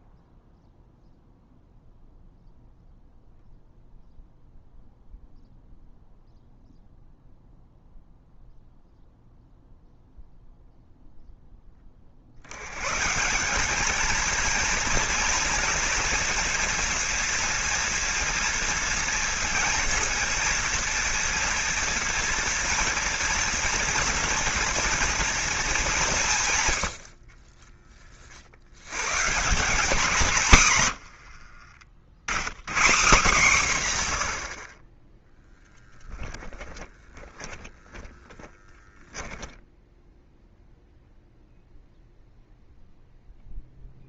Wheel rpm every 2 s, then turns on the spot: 0, 0, 0, 0, 0, 0, 120, 230, 230, 230, 230, 240, 230, 100, 120, 140, 170, 30, 20, 10, 0, 0.
26-28 30-32 36-40